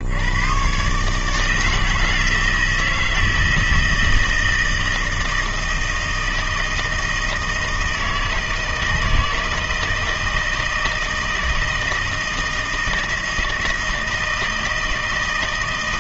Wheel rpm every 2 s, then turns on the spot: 130, 160, 160, 160, 160, 160, 160, 160.
none